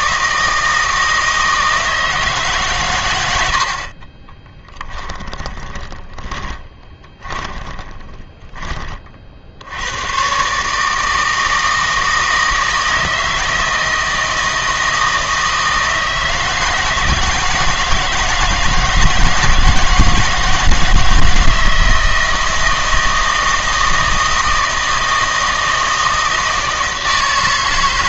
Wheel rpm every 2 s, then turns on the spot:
160, 130, 10, 20, 20, 150, 160, 160, 160, 160, 160, 160, 160, 160.
4-8